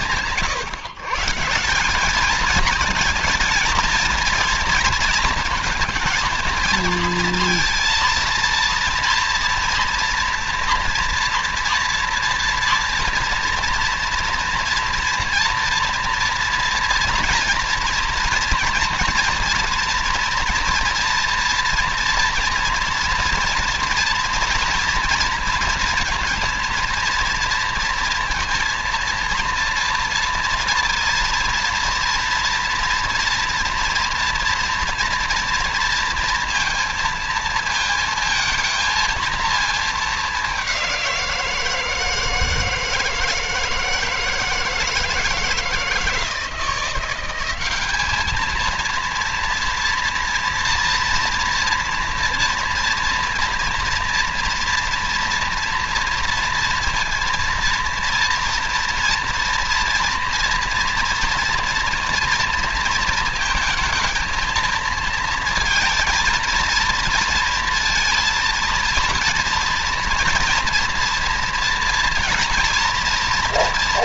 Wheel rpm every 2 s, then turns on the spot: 140, 220, 230, 230, 230, 230, 230, 240, 230, 230, 230, 230, 230, 230, 230, 230, 230, 230, 230, 220, 180, 160, 160, 170, 230, 230, 230, 230, 230, 230, 230, 230, 230, 230, 230, 230, 230.
none